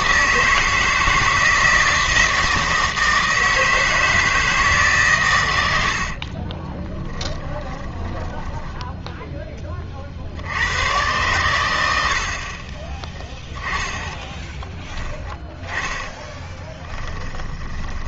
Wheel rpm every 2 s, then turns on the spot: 160, 160, 150, 20, 10, 100, 20, 10, 20.
6-10 14-18